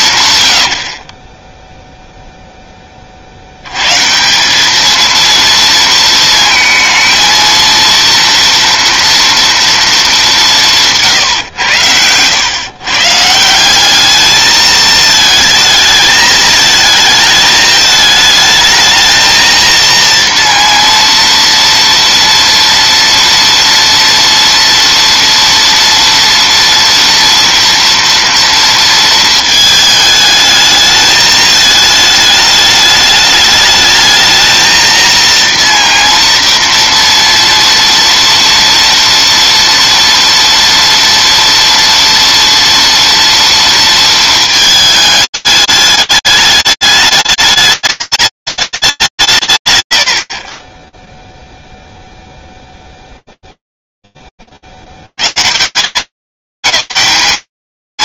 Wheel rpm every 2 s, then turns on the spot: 100, 30, 220, 220, 230, 150, 130, 220, 220, 220, 240, 230, 230, 230, 230, 210, 210, 230, 230, 230, 230, 230, 220, 210, 210, 30, 0, 40, 200.
none